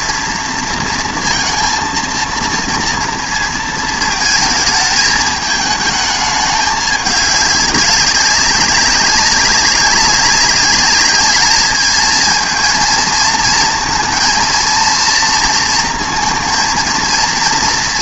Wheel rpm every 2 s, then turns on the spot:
230, 230, 210, 210, 200, 200, 230, 230, 230.
none